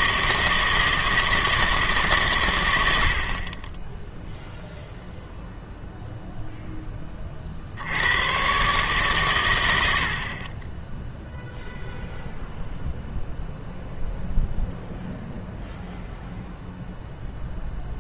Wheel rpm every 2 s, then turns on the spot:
160, 90, 0, 0, 130, 10, 0, 0, 0.
none